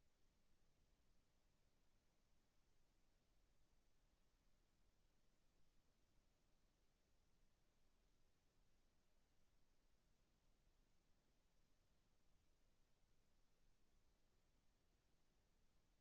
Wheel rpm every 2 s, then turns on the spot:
0, 0, 0, 0, 0, 0, 0, 0.
none